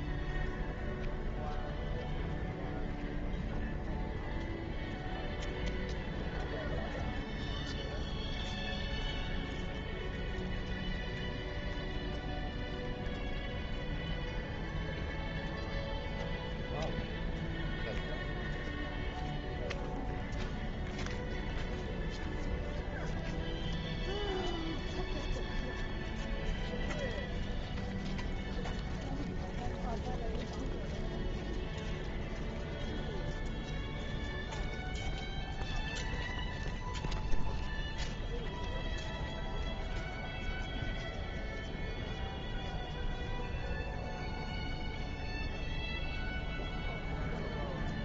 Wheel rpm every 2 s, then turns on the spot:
0, 0, 0, 0, 0, 0, 0, 0, 0, 0, 0, 0, 0, 0, 0, 0, 0, 0, 0, 0, 0, 0, 0, 0.
none